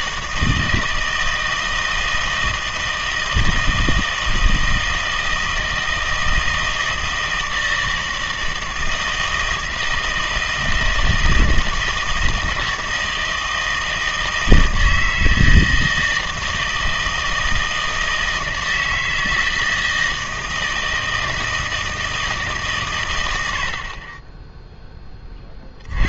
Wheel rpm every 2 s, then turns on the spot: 160, 160, 160, 160, 160, 160, 160, 160, 160, 160, 160, 140, 10.
none